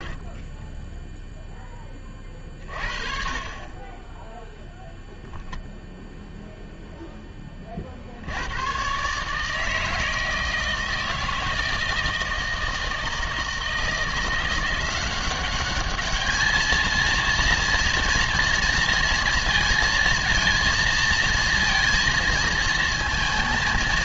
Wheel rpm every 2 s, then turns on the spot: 10, 40, 0, 0, 100, 160, 160, 180, 220, 230, 230, 220.
0-2